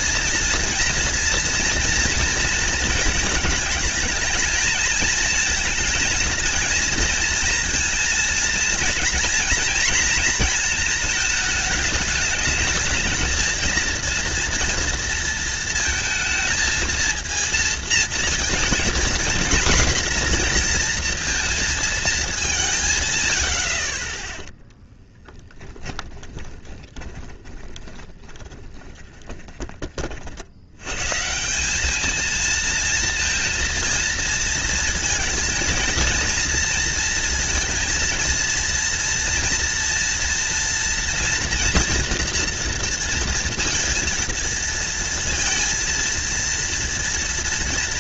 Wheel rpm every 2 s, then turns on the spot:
230, 220, 230, 230, 230, 220, 220, 230, 230, 240, 230, 120, 10, 20, 20, 130, 230, 230, 230, 230, 240, 230, 230, 230.
24-30